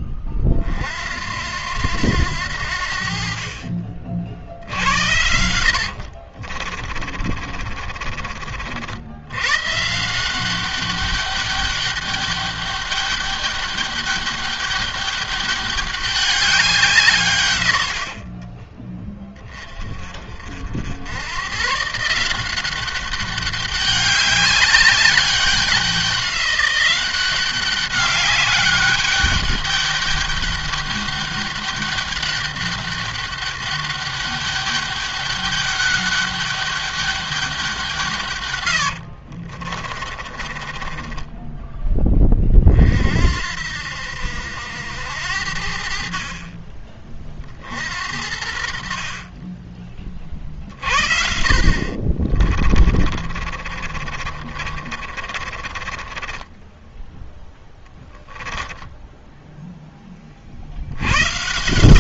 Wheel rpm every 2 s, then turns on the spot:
50, 70, 70, 30, 60, 190, 200, 200, 180, 30, 70, 190, 200, 190, 200, 200, 200, 200, 200, 100, 20, 40, 80, 30, 60, 40, 30, 40, 10, 10, 60.
6-8 18-20 38-42 52-60